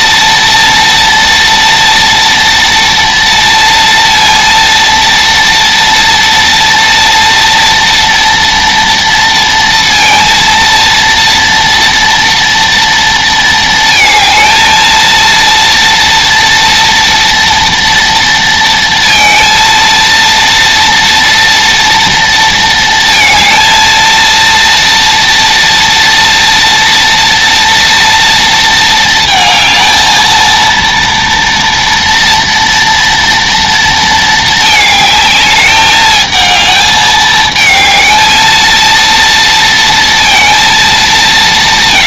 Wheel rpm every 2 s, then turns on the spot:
230, 230, 230, 230, 230, 230, 230, 230, 230, 230, 230, 230, 230, 230, 230, 230, 230, 220, 220, 230, 220.
none